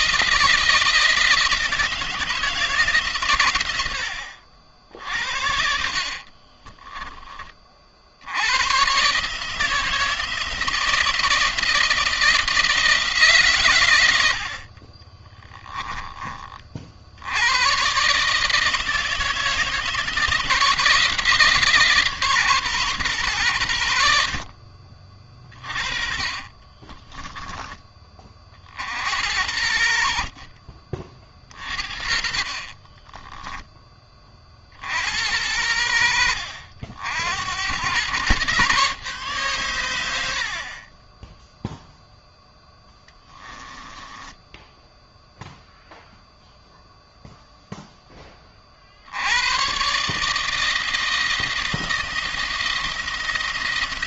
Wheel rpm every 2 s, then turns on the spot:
160, 150, 60, 30, 110, 160, 160, 40, 50, 160, 160, 130, 50, 20, 50, 50, 30, 40, 70, 130, 40, 10, 10, 0, 40, 160, 170.
6-8 14-16 26-28 30-34 40-46